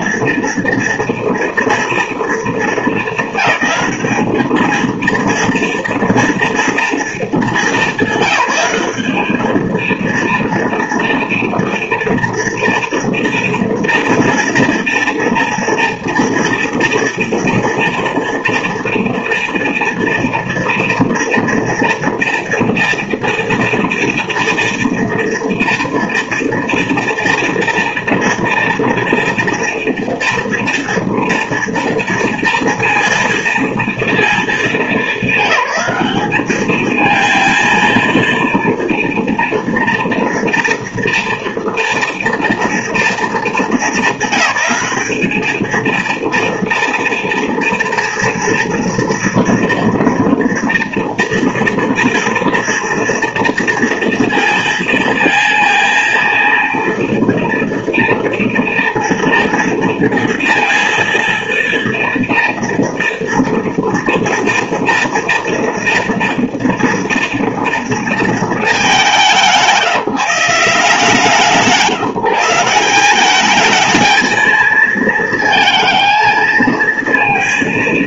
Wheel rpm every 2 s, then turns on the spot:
230, 230, 220, 230, 200, 230, 230, 230, 230, 230, 230, 230, 230, 230, 230, 230, 230, 220, 200, 230, 230, 230, 200, 230, 230, 230, 230, 230, 230, 230, 230, 230, 240, 230, 230, 170, 160, 220, 220.
none